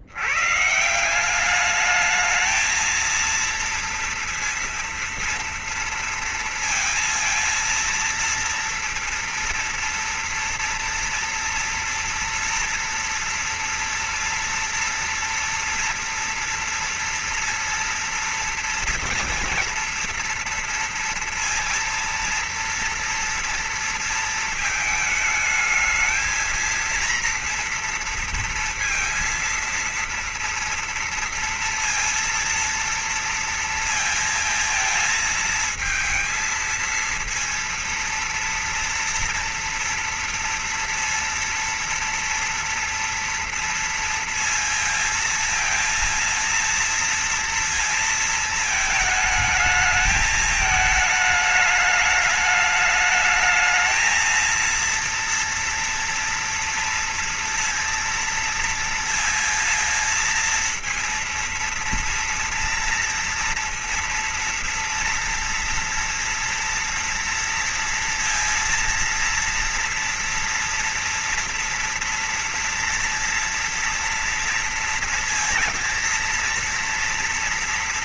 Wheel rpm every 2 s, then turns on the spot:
150, 220, 230, 230, 230, 230, 230, 230, 230, 230, 230, 230, 220, 230, 230, 230, 230, 220, 230, 230, 230, 230, 230, 230, 220, 210, 210, 230, 230, 230, 230, 240, 230, 230, 230, 240, 230, 240, 230.
none